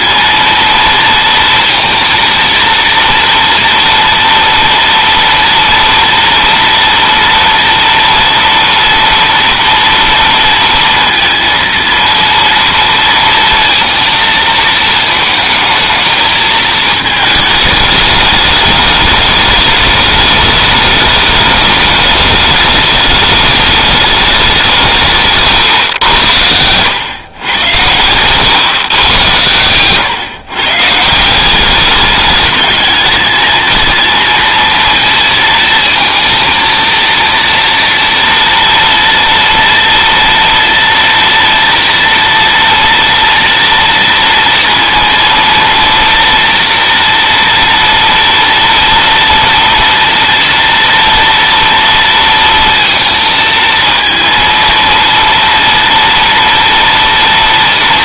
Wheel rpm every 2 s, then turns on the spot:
230, 230, 230, 230, 230, 230, 230, 230, 220, 210, 210, 210, 200, 90, 110, 120, 210, 230, 220, 230, 230, 230, 230, 230, 230, 230, 230, 230, 230.
28-30